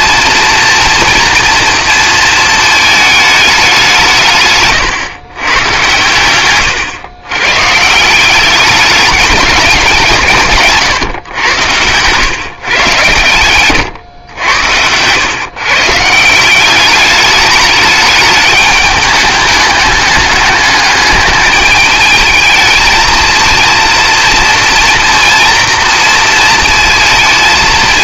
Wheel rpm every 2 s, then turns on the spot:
230, 220, 140, 110, 200, 150, 120, 100, 190, 210, 210, 220, 240, 230.
4-6 10-12 14-16